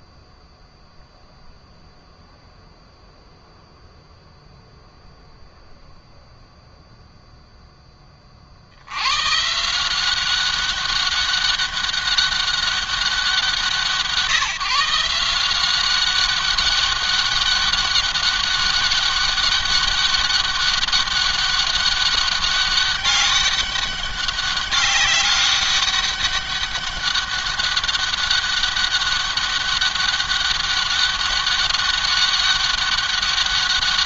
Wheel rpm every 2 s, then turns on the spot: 0, 0, 0, 0, 80, 200, 190, 160, 200, 200, 200, 200, 200, 200, 200, 200, 200.
none